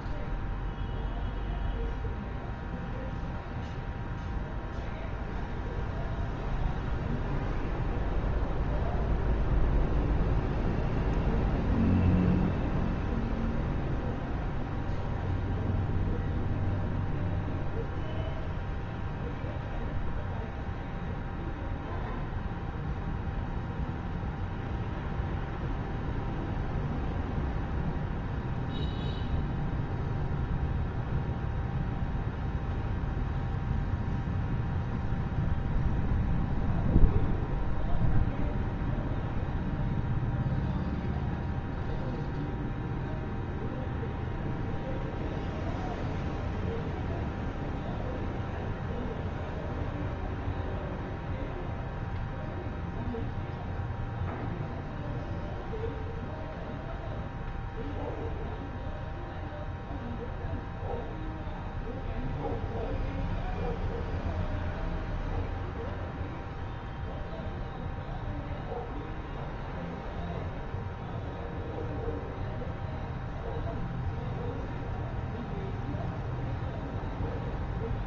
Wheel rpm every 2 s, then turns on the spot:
0, 0, 0, 0, 0, 0, 0, 0, 0, 0, 0, 0, 0, 0, 0, 0, 0, 0, 0, 0, 0, 0, 0, 0, 0, 0, 0, 0, 0, 0, 0, 0, 0, 0, 0, 0, 0, 0, 0.
none